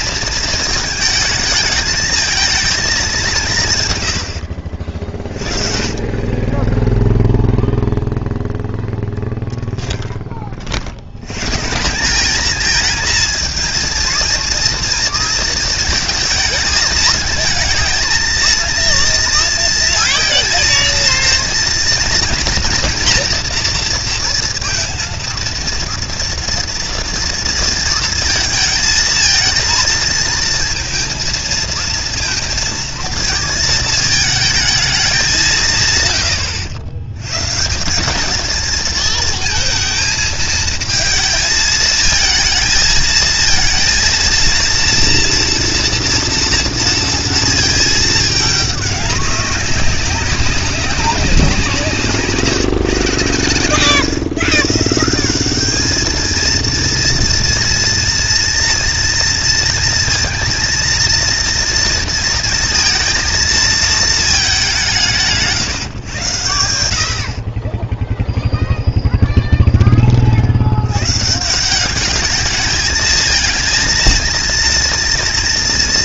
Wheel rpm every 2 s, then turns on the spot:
220, 220, 70, 20, 0, 50, 220, 230, 220, 230, 230, 240, 230, 230, 220, 230, 230, 220, 110, 220, 220, 220, 230, 230, 210, 190, 150, 150, 230, 230, 230, 230, 210, 100, 0, 70, 210, 230.
none